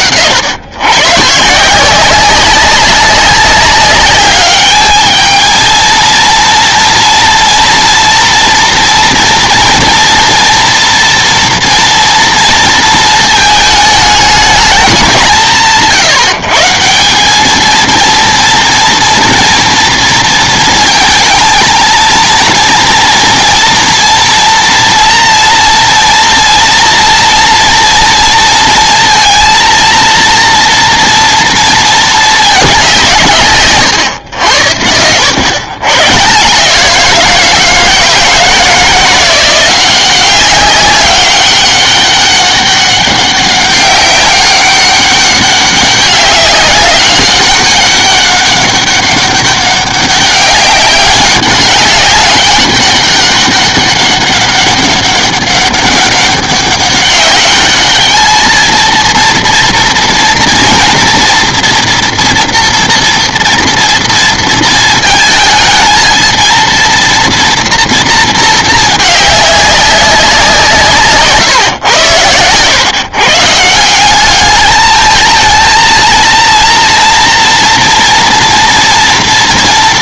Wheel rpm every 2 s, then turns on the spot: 120, 190, 210, 230, 230, 240, 220, 200, 170, 230, 230, 230, 230, 230, 230, 230, 200, 90, 170, 170, 190, 200, 200, 200, 200, 190, 200, 200, 200, 220, 230, 230, 230, 230, 220, 160, 120, 210, 230, 240.
none